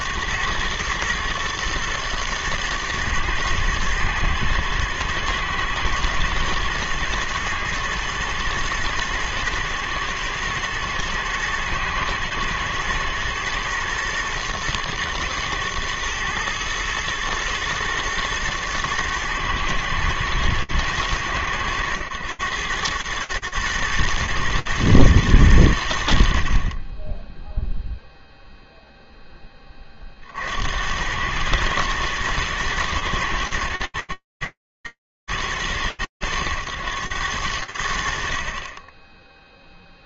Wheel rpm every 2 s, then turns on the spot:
100, 110, 110, 120, 110, 120, 120, 120, 110, 110, 110, 110, 110, 20, 10, 100, 110, 110, 100, 10.
none